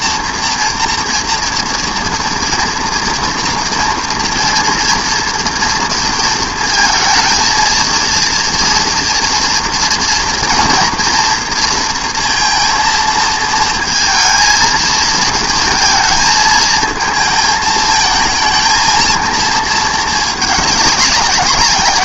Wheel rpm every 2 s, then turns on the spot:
240, 230, 230, 220, 230, 230, 230, 230, 220, 220, 210.
none